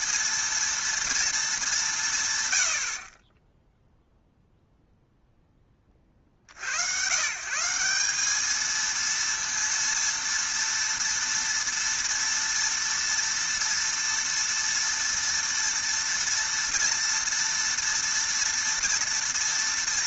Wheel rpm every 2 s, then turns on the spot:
230, 100, 0, 80, 220, 230, 230, 230, 230, 230.
none